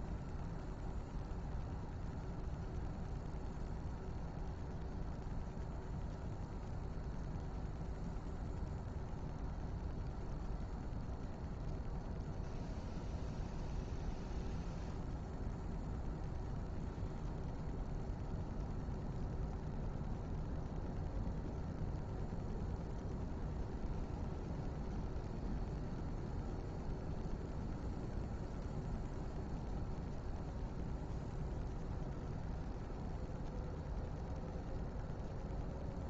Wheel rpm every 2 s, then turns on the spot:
0, 0, 0, 0, 0, 0, 0, 0, 0, 0, 0, 0, 0, 0, 0, 0, 0, 0.
none